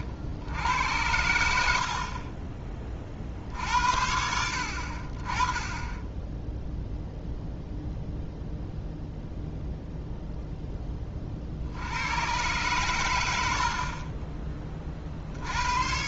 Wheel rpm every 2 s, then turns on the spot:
80, 20, 60, 0, 0, 10, 110, 30.
none